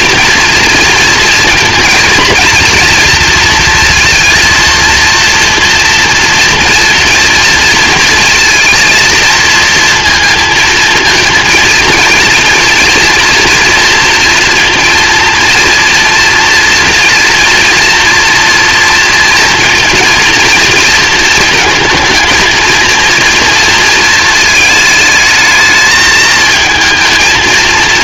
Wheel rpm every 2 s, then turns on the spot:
230, 230, 230, 230, 220, 230, 230, 230, 230, 230, 230, 230, 220, 220.
none